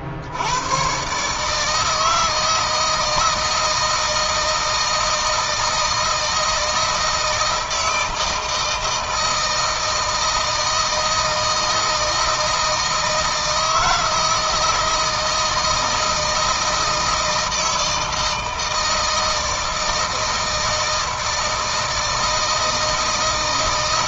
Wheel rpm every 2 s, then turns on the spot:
120, 160, 160, 160, 160, 160, 160, 160, 170, 160, 160, 160.
none